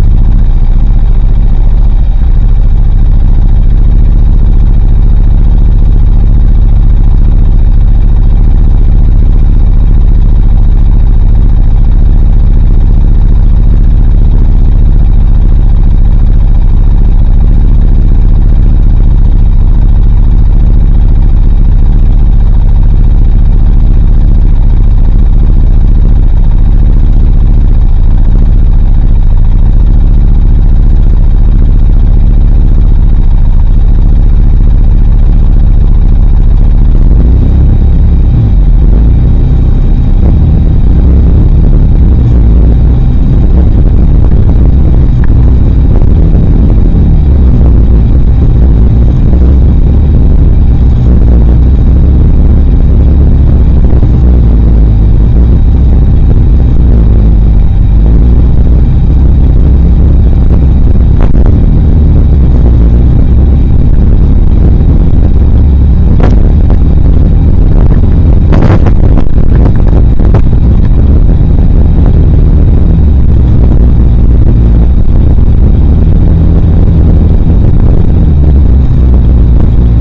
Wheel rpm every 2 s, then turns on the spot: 0, 0, 0, 0, 0, 0, 0, 0, 0, 0, 0, 0, 0, 0, 0, 0, 0, 0, 0, 0, 0, 0, 0, 0, 0, 0, 0, 0, 0, 0, 0, 0, 0, 0, 0, 0, 0, 0, 0, 0.
none